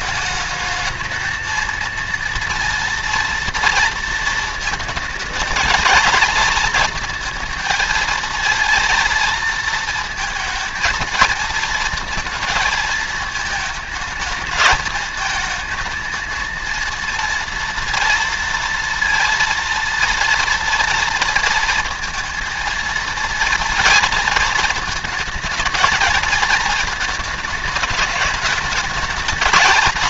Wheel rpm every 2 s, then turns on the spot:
220, 230, 230, 220, 230, 220, 220, 220, 230, 230, 230, 230, 230, 220, 210.
none